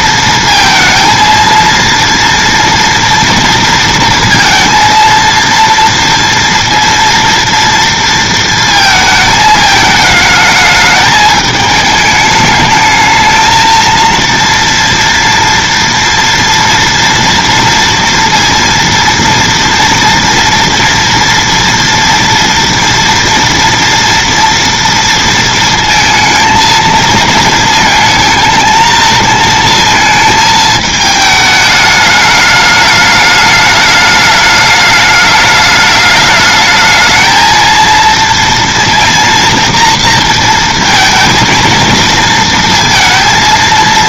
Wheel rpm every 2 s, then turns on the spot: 230, 230, 230, 230, 230, 220, 210, 230, 230, 230, 230, 230, 230, 220, 220, 220, 210, 210, 210, 230, 230, 230.
none